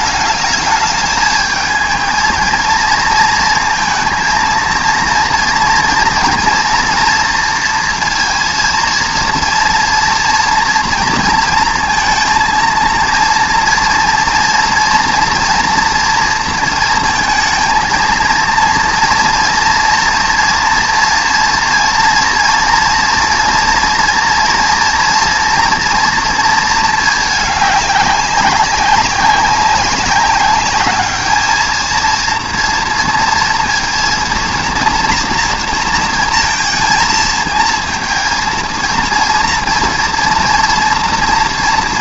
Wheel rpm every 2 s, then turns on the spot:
210, 230, 230, 230, 230, 230, 230, 230, 230, 230, 230, 230, 230, 230, 200, 210, 230, 230, 230, 230, 230.
none